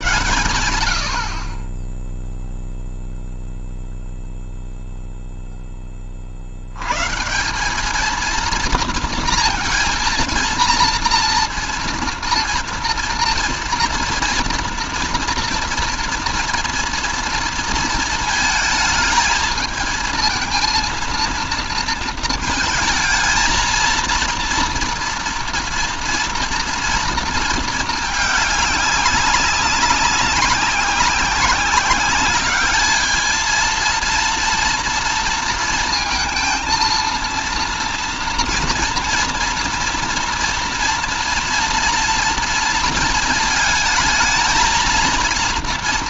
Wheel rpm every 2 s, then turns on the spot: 100, 0, 0, 50, 230, 230, 240, 230, 230, 220, 220, 220, 230, 240, 210, 190, 200, 230, 230, 230, 230, 230, 230.
none